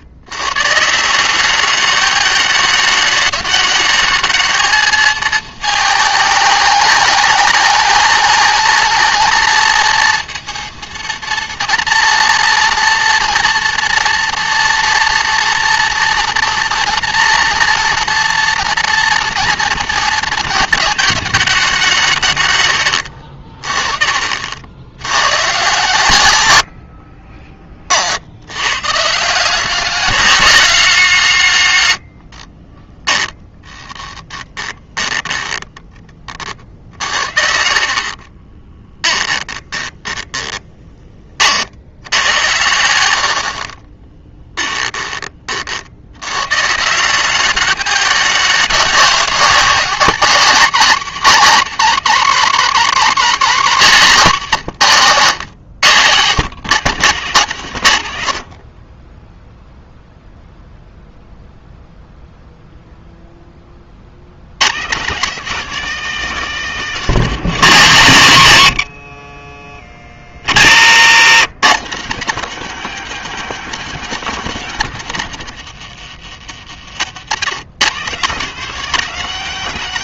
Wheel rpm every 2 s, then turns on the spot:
130, 210, 220, 210, 230, 230, 230, 230, 240, 230, 220, 110, 70, 90, 110, 180, 30, 20, 50, 20, 20, 90, 10, 140, 200, 240, 250, 160, 150, 50, 0, 0, 120, 220, 150, 120, 220, 200, 110, 210.
26-28 32-42 44-46 70-72 76-78